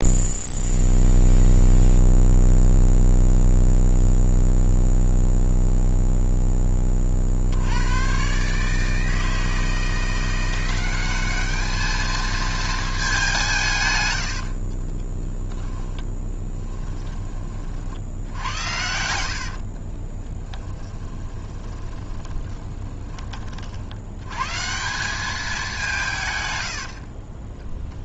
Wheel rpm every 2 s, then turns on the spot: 0, 0, 0, 30, 150, 190, 220, 50, 20, 70, 10, 20, 160, 70.
14-24 26-28